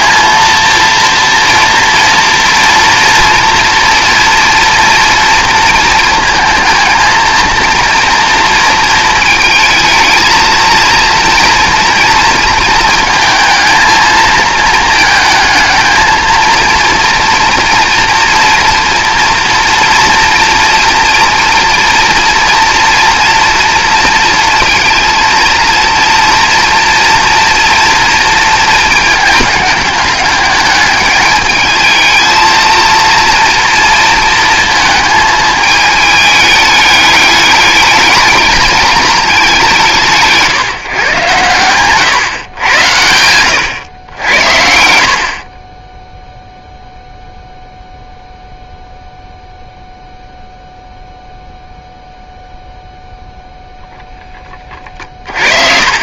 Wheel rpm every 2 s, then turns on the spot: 230, 240, 230, 230, 220, 230, 230, 220, 230, 230, 230, 230, 230, 230, 230, 210, 220, 220, 210, 220, 160, 100, 70, 0, 0, 0, 0, 30.
54-56